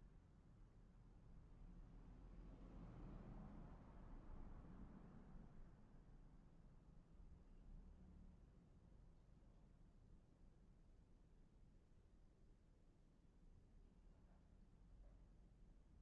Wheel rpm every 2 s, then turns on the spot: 0, 0, 0, 0, 0, 0, 0, 0.
none